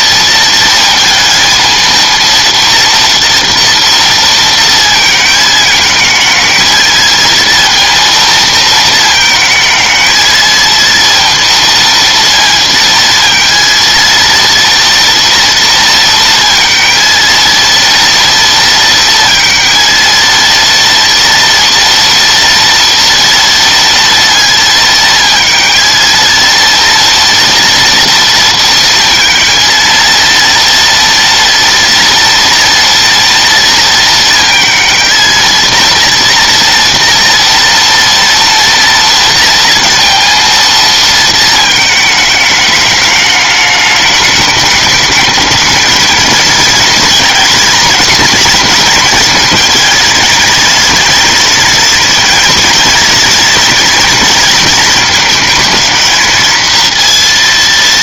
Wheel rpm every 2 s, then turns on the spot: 220, 230, 230, 220, 230, 220, 230, 230, 230, 230, 230, 230, 230, 230, 230, 230, 230, 230, 230, 230, 230, 210, 210, 230, 240, 230, 230, 220, 230.
none